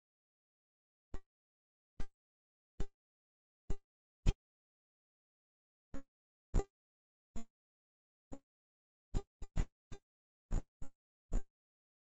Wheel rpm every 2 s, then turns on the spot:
0, 0, 0, 0, 0, 0.
none